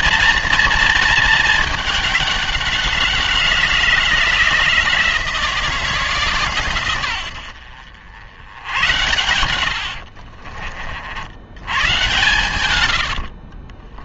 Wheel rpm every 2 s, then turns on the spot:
230, 190, 170, 120, 100, 50, 120.
none